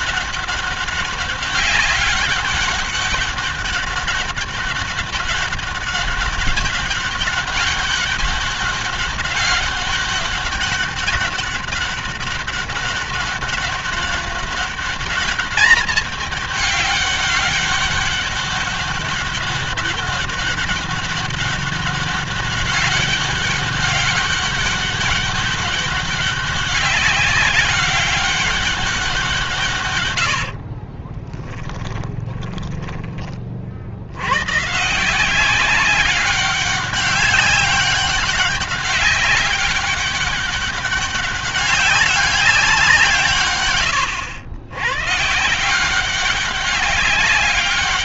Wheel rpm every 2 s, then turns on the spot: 200, 200, 200, 200, 200, 200, 200, 200, 200, 200, 200, 200, 200, 200, 190, 40, 20, 140, 200, 200, 200, 180, 110, 190.
30-32